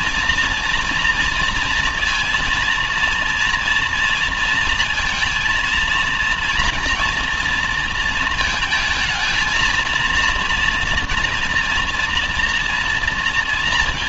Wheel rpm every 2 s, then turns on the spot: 230, 230, 230, 230, 220, 230, 230.
none